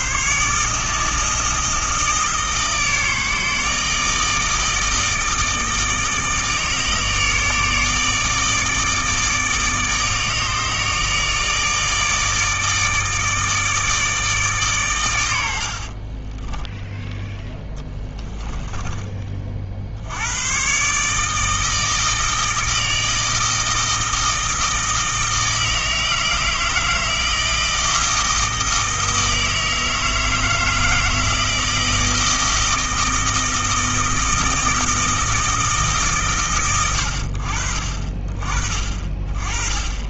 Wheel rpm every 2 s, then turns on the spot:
150, 150, 160, 160, 150, 150, 150, 130, 10, 10, 120, 160, 160, 160, 160, 160, 160, 160, 110, 40.
18-20